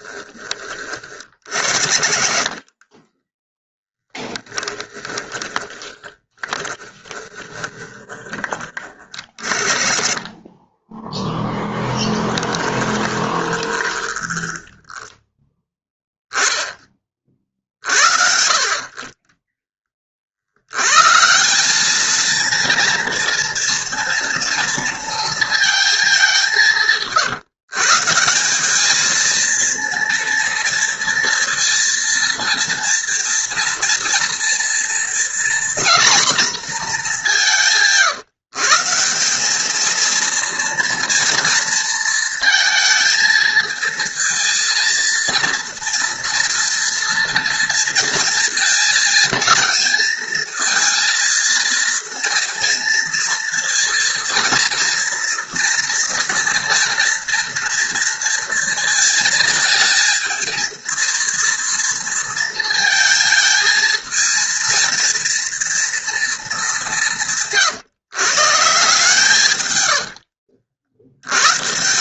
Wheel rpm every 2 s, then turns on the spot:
40, 10, 20, 10, 30, 10, 20, 10, 50, 30, 210, 230, 210, 150, 230, 230, 230, 240, 150, 220, 230, 230, 230, 230, 220, 230, 230, 230, 230, 220, 230, 220, 230, 140, 120, 110.
12-14 68-70